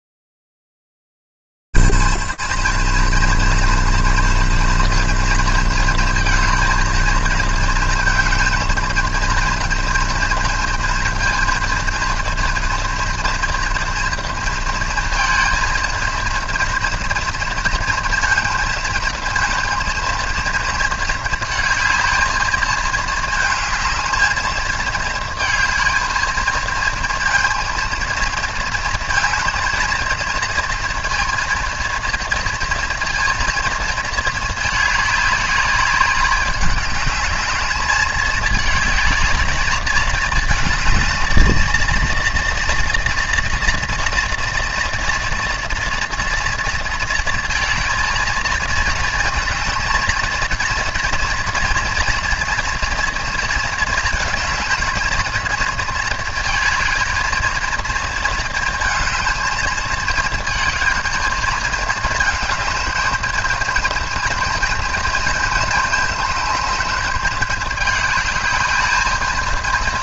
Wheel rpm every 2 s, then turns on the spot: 20, 210, 230, 220, 220, 230, 230, 230, 220, 230, 220, 220, 220, 220, 230, 220, 230, 230, 200, 210, 220, 230, 240, 240, 220, 230, 230, 220, 220, 230, 220, 220, 230, 220, 210.
none